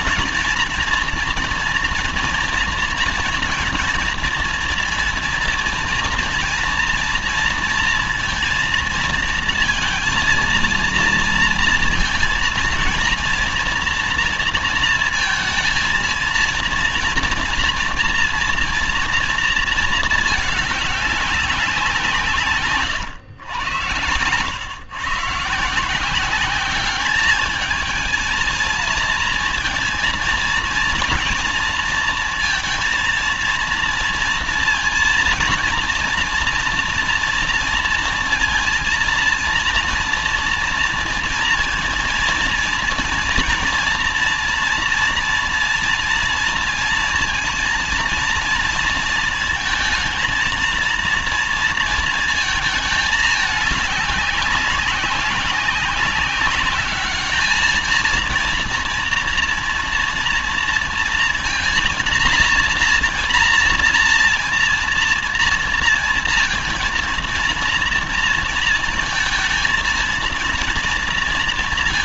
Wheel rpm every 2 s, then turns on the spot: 240, 230, 230, 230, 230, 230, 230, 230, 230, 230, 200, 110, 120, 200, 220, 230, 230, 230, 230, 230, 230, 230, 230, 230, 230, 230, 220, 200, 200, 230, 230, 230, 230, 230, 230, 230.
none